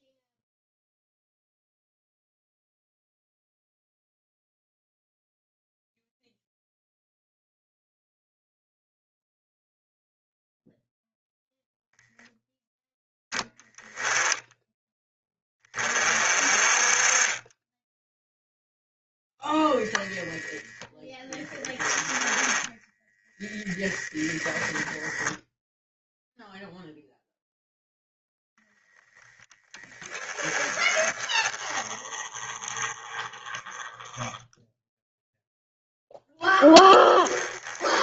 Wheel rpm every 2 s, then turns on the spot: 0, 0, 0, 0, 0, 0, 10, 10, 30, 0, 10, 10, 10, 0, 10, 20, 20, 10, 10.
22-24